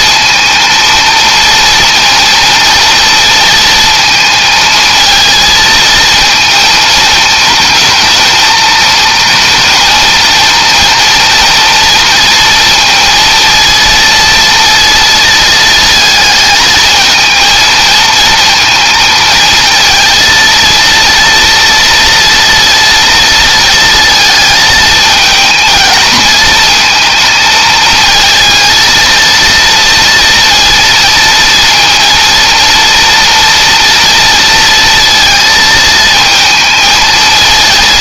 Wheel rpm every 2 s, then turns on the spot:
230, 230, 220, 220, 230, 230, 230, 230, 230, 230, 230, 230, 220, 220, 230, 230, 230, 230, 230.
none